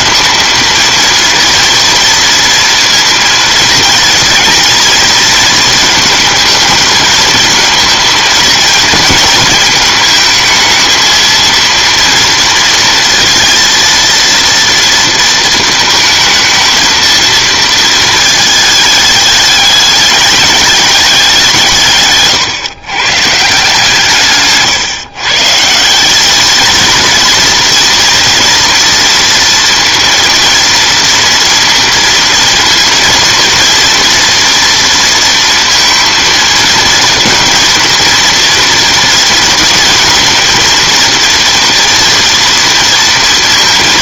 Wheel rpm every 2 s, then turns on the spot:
230, 230, 230, 220, 220, 220, 230, 230, 220, 220, 210, 120, 140, 220, 230, 230, 230, 230, 230, 230, 230, 230.
none